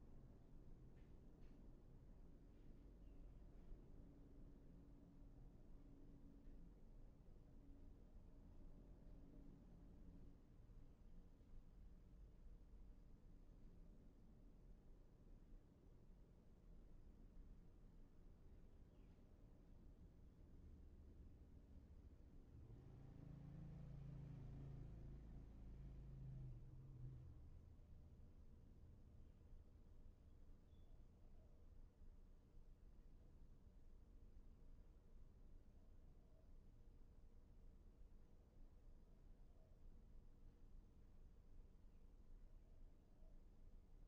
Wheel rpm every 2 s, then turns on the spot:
0, 0, 0, 0, 0, 0, 0, 0, 0, 0, 0, 0, 0, 0, 0, 0, 0, 0, 0, 0, 0, 0.
none